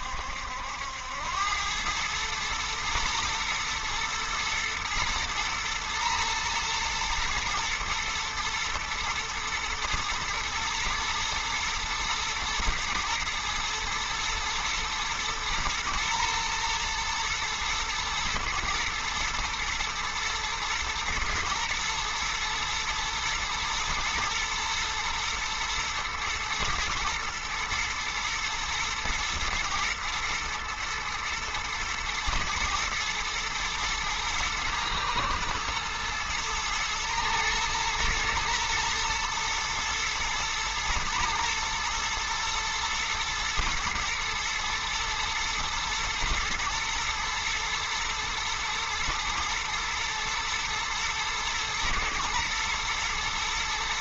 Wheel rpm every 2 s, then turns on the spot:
80, 110, 120, 110, 110, 110, 120, 110, 110, 120, 120, 120, 120, 120, 120, 120, 110, 110, 110, 110, 120, 120, 110, 120, 110, 110, 120.
none